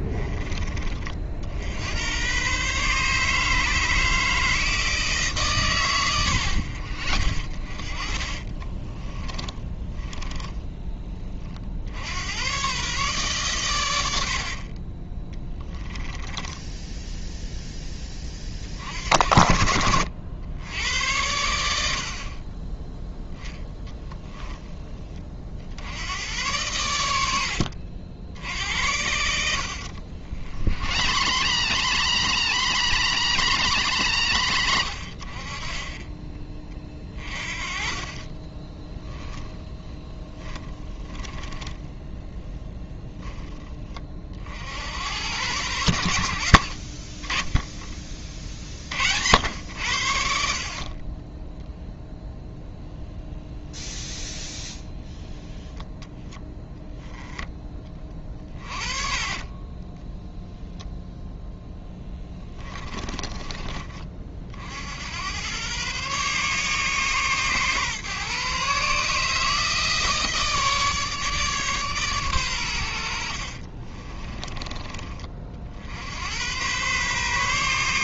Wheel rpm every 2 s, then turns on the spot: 30, 140, 160, 60, 20, 20, 130, 40, 10, 50, 90, 10, 20, 100, 80, 80, 130, 70, 40, 10, 20, 0, 80, 60, 60, 40, 0, 10, 0, 30, 0, 20, 70, 140, 140, 150, 80, 30, 120.
6-10 14-18 28-42 46-48 50-52 58-60 62-64